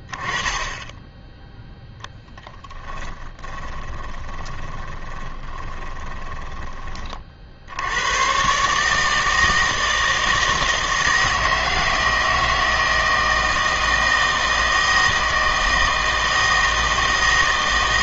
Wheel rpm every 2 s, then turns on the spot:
10, 10, 20, 20, 140, 160, 160, 160, 160.
2-6